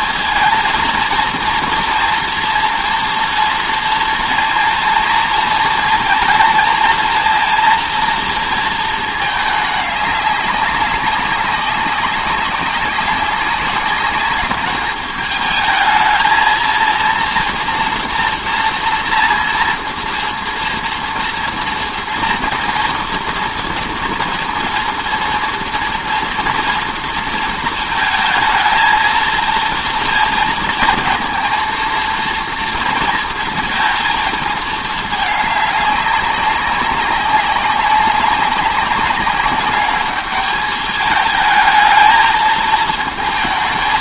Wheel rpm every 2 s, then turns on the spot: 230, 230, 230, 230, 230, 200, 200, 210, 230, 240, 230, 230, 230, 230, 220, 230, 240, 220, 200, 190, 210, 220.
none